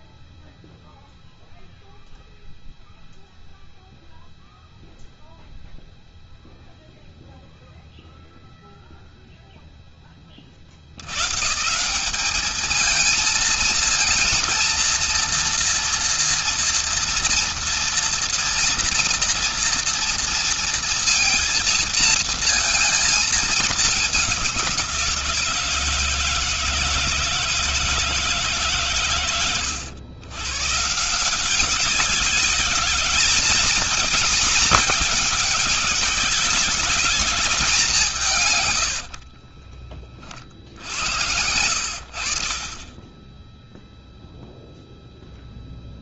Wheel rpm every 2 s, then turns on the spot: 0, 0, 0, 0, 0, 90, 220, 230, 230, 230, 230, 220, 180, 160, 140, 140, 200, 220, 200, 100, 60, 40, 0.
38-40